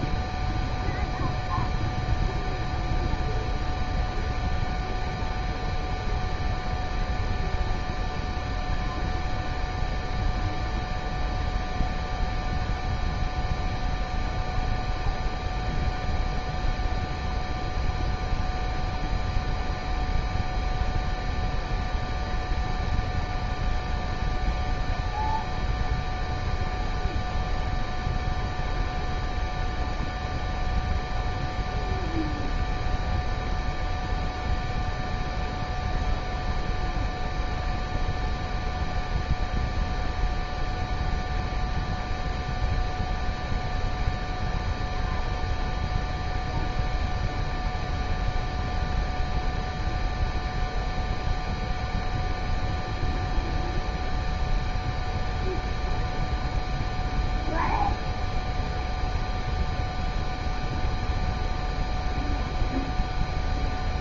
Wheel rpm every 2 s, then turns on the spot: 0, 0, 0, 0, 0, 0, 0, 0, 0, 0, 0, 0, 0, 0, 0, 0, 0, 0, 0, 0, 0, 0, 0, 0, 0, 0, 0, 0, 0, 0, 0, 0.
none